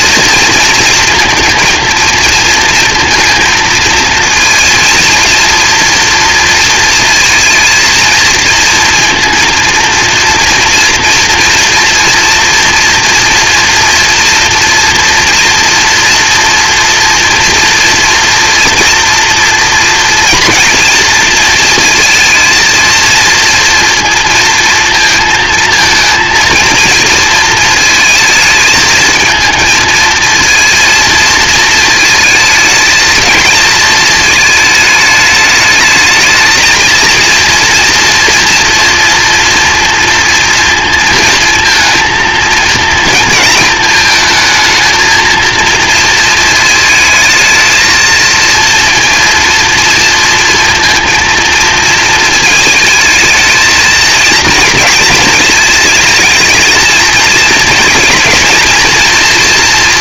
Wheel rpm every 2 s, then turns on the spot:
230, 230, 230, 230, 230, 230, 230, 230, 230, 230, 240, 230, 230, 230, 220, 230, 220, 220, 230, 230, 230, 220, 220, 220, 230, 230, 220, 230, 220, 230.
none